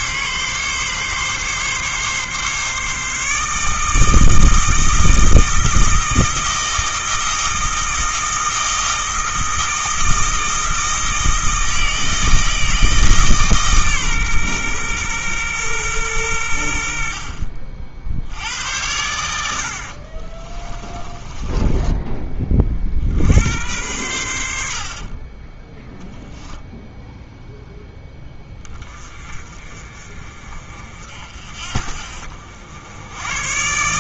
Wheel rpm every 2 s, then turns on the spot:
140, 150, 160, 160, 160, 160, 160, 120, 60, 90, 20, 50, 50, 0, 30, 50, 90.
20-22 24-26